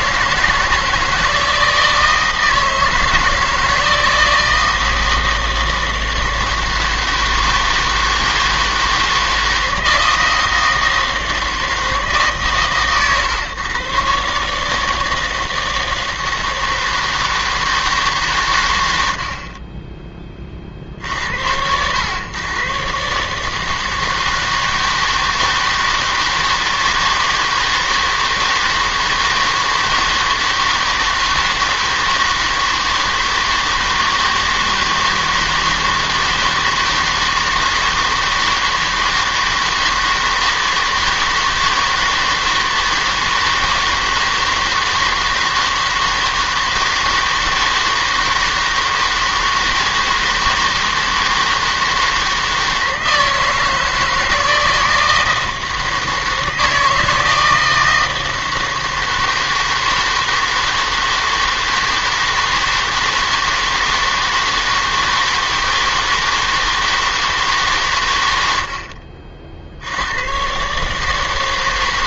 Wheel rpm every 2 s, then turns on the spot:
160, 160, 160, 160, 160, 160, 130, 150, 160, 100, 50, 120, 160, 160, 160, 160, 160, 160, 160, 160, 160, 160, 160, 160, 160, 160, 160, 160, 160, 160, 160, 160, 160, 160, 70, 130.
none